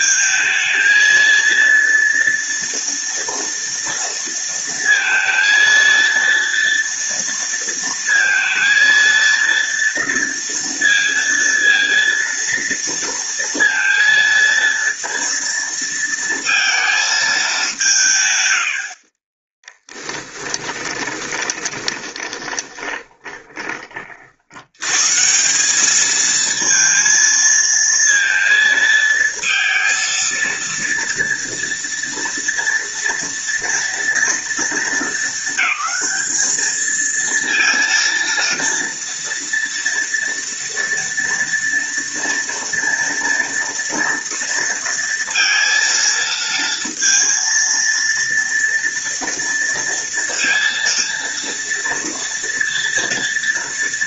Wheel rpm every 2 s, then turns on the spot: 230, 230, 230, 230, 230, 230, 230, 230, 210, 30, 20, 20, 160, 230, 220, 230, 230, 210, 230, 230, 230, 230, 230, 230, 230, 230, 230.
18-24